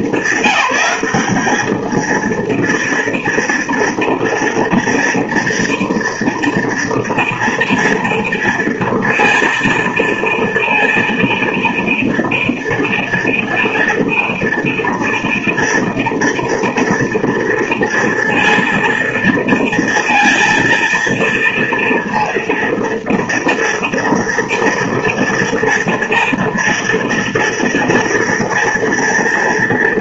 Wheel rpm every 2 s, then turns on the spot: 200, 230, 230, 230, 230, 230, 240, 230, 230, 230, 230, 230, 240, 230, 230.
none